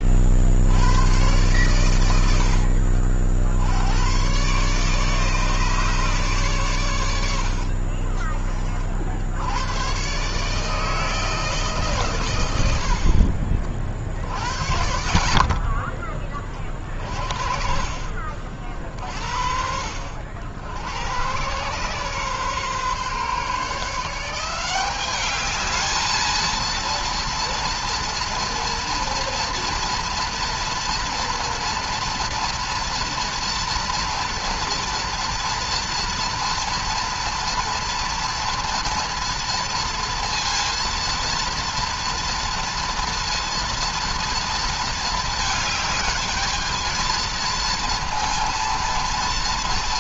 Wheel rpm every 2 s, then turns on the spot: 70, 60, 140, 120, 50, 150, 80, 50, 30, 40, 80, 130, 180, 230, 240, 230, 230, 230, 230, 230, 230, 230, 220, 220, 230.
none